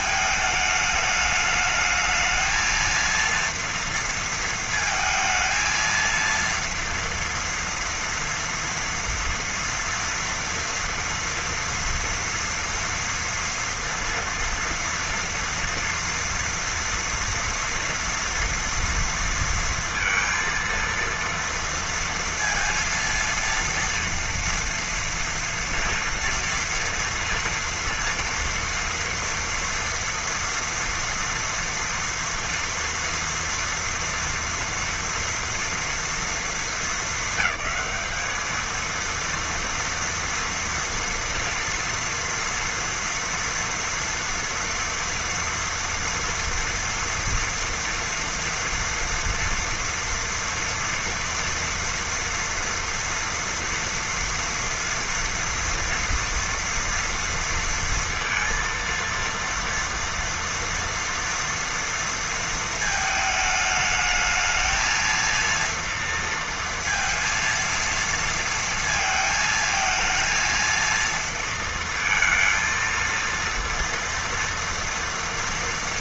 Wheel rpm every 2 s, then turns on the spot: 210, 230, 220, 230, 230, 230, 230, 230, 240, 230, 230, 230, 230, 230, 230, 230, 240, 230, 220, 230, 230, 230, 230, 240, 230, 240, 230, 230, 230, 230, 240, 220, 230, 230, 230, 230, 230, 230.
none